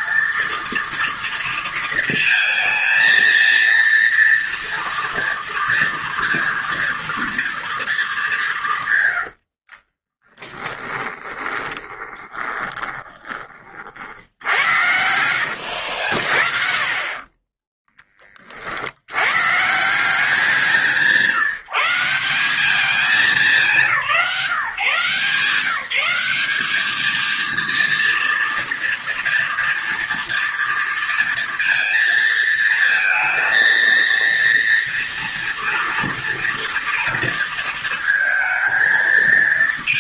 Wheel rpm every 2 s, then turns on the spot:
230, 230, 230, 230, 150, 20, 20, 70, 30, 70, 160, 200, 160, 220, 230, 230, 230, 230, 230, 230.
10-16